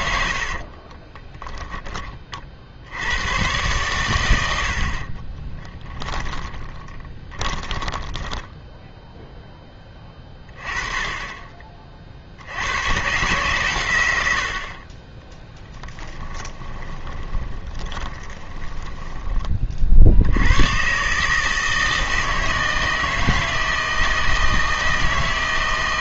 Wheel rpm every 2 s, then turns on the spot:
40, 60, 70, 20, 10, 20, 90, 50, 30, 10, 120, 160, 160.
0-2 6-10 16-20